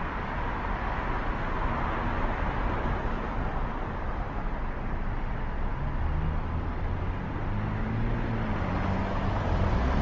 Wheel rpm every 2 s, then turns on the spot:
0, 0, 0, 0, 0.
none